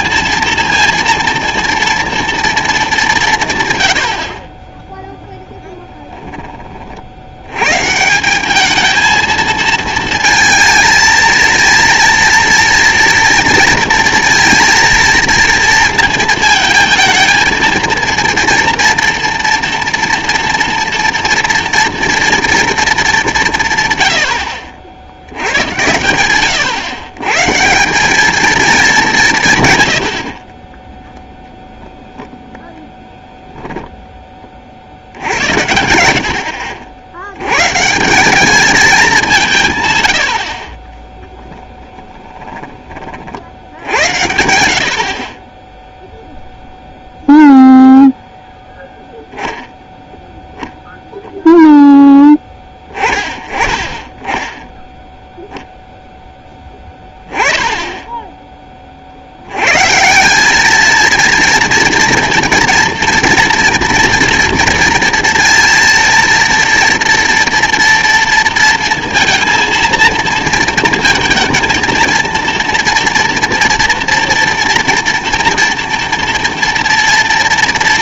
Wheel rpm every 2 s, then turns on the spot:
230, 230, 30, 20, 200, 230, 230, 230, 220, 230, 230, 230, 70, 110, 220, 40, 0, 20, 70, 200, 50, 20, 80, 0, 0, 0, 10, 10, 10, 10, 190, 230, 230, 230, 230, 220, 230, 230, 230.
42-44